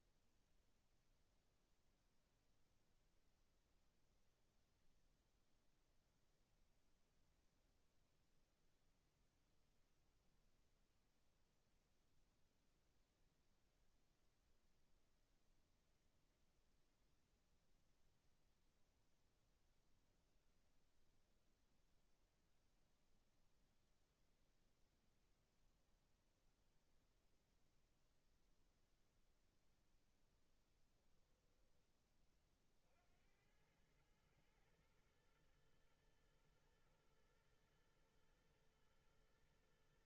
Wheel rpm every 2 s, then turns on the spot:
0, 0, 0, 0, 0, 0, 0, 0, 0, 0, 0, 0, 0, 0, 0, 0, 40, 110, 110, 110.
none